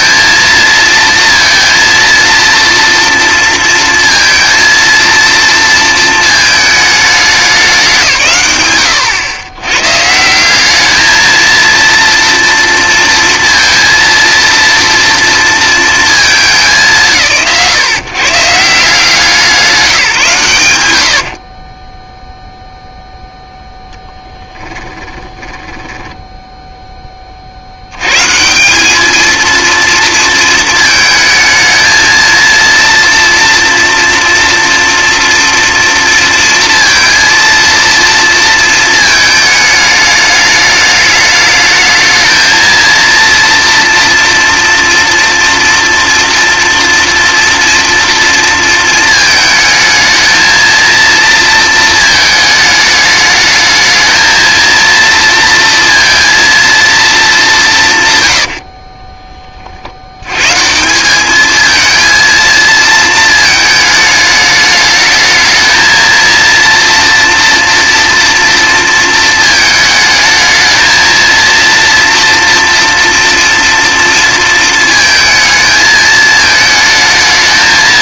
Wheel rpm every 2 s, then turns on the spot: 230, 230, 230, 210, 110, 210, 230, 230, 190, 170, 100, 0, 10, 10, 190, 220, 230, 230, 230, 230, 210, 230, 230, 240, 230, 230, 220, 230, 230, 40, 160, 230, 210, 230, 230, 220, 230, 230, 220.
24-26 58-60